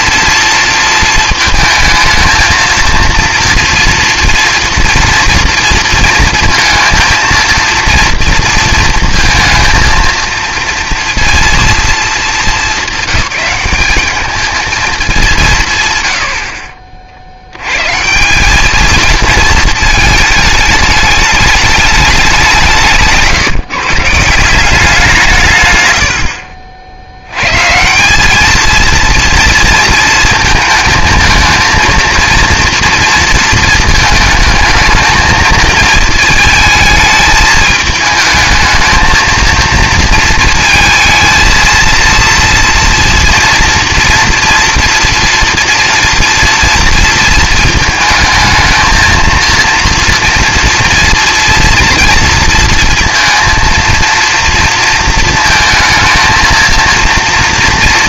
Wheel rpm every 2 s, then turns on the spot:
230, 230, 230, 230, 230, 230, 200, 220, 50, 210, 210, 180, 180, 60, 230, 220, 230, 220, 220, 220, 230, 230, 230, 230, 220, 240, 230, 230, 230.
none